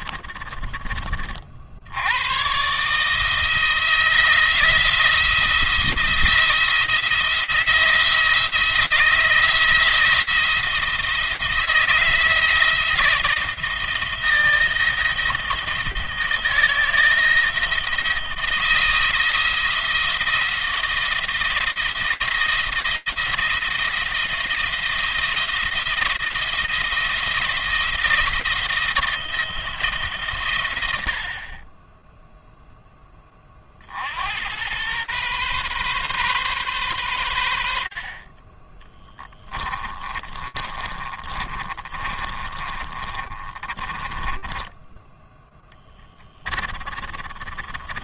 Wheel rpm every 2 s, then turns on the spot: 40, 140, 170, 170, 170, 160, 160, 160, 160, 170, 170, 170, 170, 170, 170, 80, 10, 110, 120, 20, 30, 30, 10, 20.
38-48